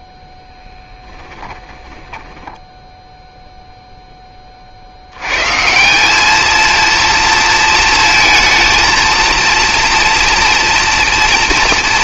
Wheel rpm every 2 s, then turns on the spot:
10, 10, 40, 220, 230, 230.
2-4